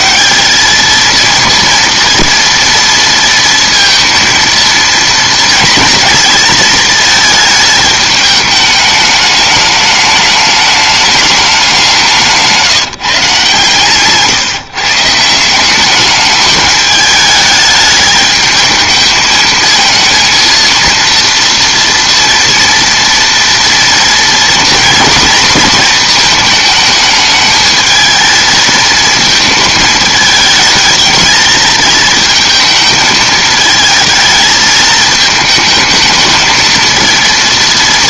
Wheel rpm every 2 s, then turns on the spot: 200, 230, 230, 230, 210, 210, 160, 150, 210, 220, 230, 240, 230, 220, 230, 210, 220, 220, 220.
none